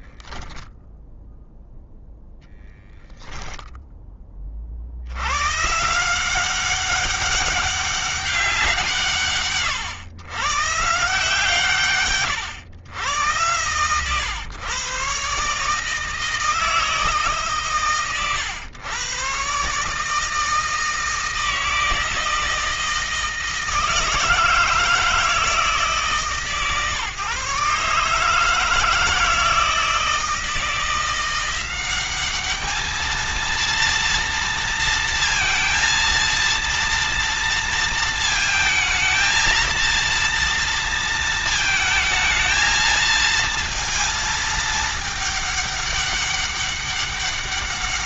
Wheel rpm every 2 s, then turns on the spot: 10, 0, 40, 190, 170, 140, 110, 120, 160, 140, 160, 160, 160, 140, 160, 170, 210, 230, 230, 220, 230, 220, 220, 200.
none